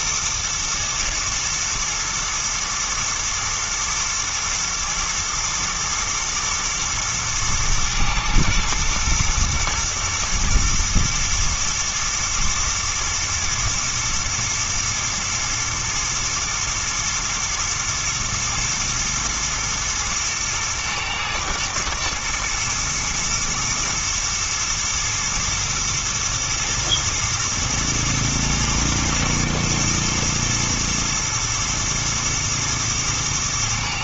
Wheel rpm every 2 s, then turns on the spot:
110, 120, 110, 110, 110, 120, 120, 110, 110, 120, 120, 110, 110, 110, 110, 110, 110.
none